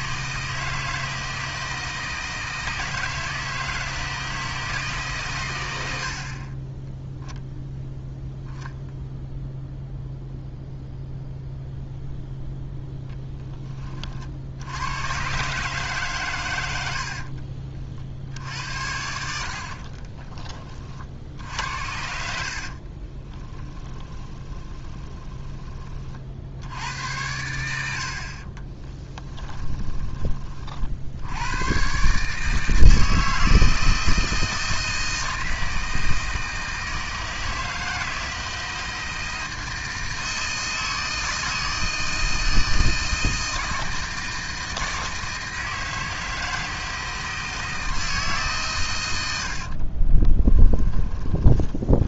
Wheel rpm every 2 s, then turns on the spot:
160, 160, 160, 10, 0, 0, 10, 90, 100, 70, 30, 60, 20, 80, 30, 50, 160, 160, 160, 160, 160, 160, 160, 160, 130, 10.
22-26 28-30